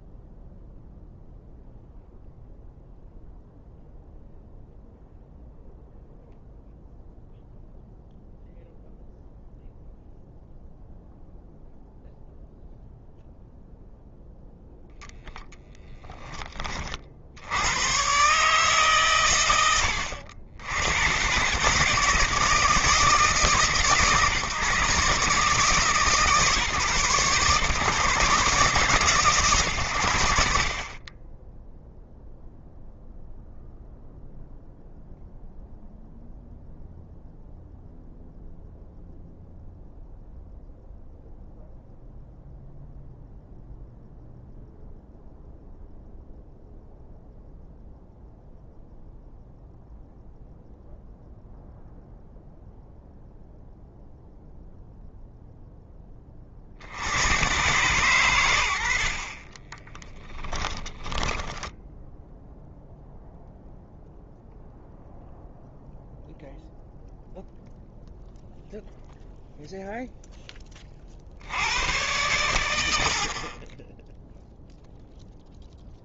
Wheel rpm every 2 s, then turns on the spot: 0, 0, 0, 0, 0, 0, 0, 0, 50, 110, 100, 150, 140, 130, 120, 30, 0, 0, 0, 0, 0, 0, 0, 0, 0, 0, 0, 0, 80, 70, 10, 0, 0, 0, 0, 40, 70, 0.
60-62